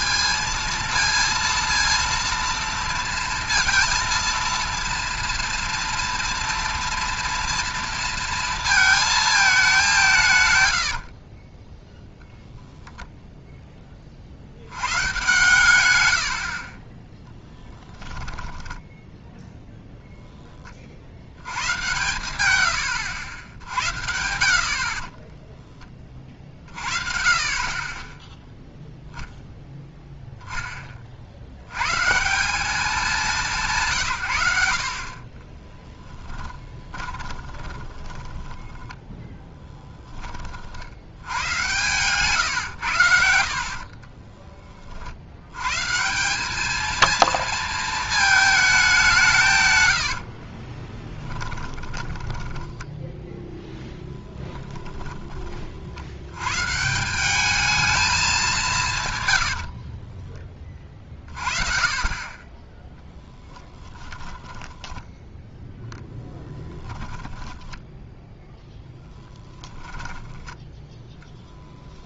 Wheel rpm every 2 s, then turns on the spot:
230, 230, 230, 230, 180, 10, 10, 130, 10, 0, 100, 80, 10, 40, 0, 30, 190, 40, 20, 10, 80, 80, 60, 230, 180, 10, 10, 20, 160, 150, 30, 10, 10, 20, 0, 10.
10-12 16-18 22-26 36-40 50-52 54-56 64-68